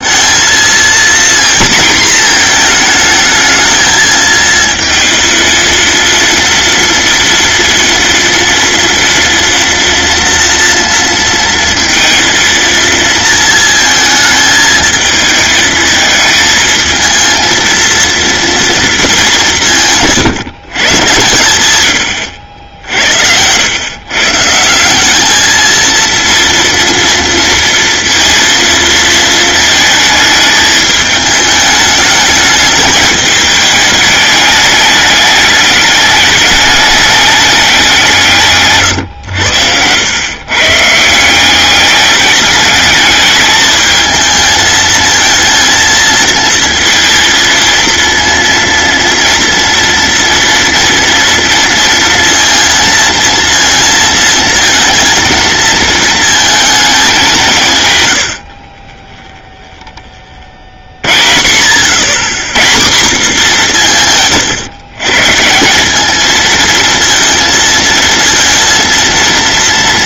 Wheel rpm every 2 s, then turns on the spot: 230, 230, 230, 230, 230, 230, 230, 220, 230, 230, 130, 80, 170, 230, 230, 210, 210, 210, 210, 130, 140, 210, 220, 230, 230, 230, 230, 230, 220, 30, 50, 170, 120, 230, 230.
none